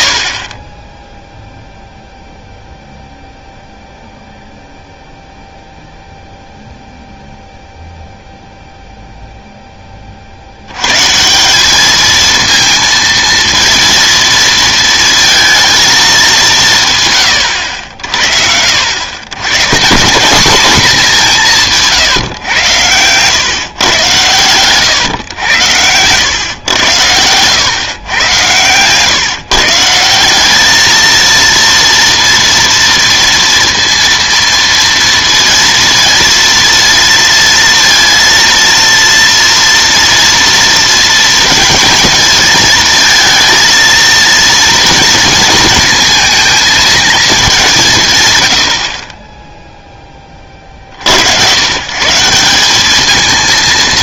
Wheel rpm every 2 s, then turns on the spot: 20, 0, 0, 0, 0, 100, 230, 230, 170, 70, 220, 110, 110, 110, 120, 210, 240, 230, 230, 230, 230, 220, 230, 230, 100, 50, 190.
none